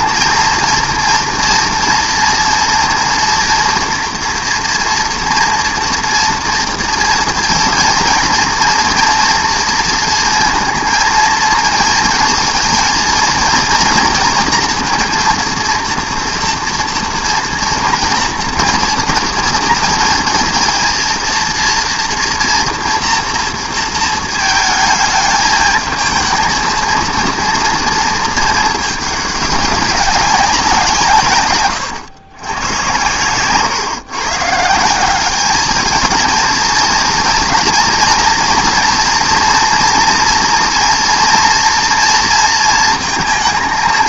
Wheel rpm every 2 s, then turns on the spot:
230, 230, 230, 230, 230, 230, 230, 230, 230, 230, 230, 230, 220, 230, 220, 180, 120, 150, 230, 230, 230, 230.
none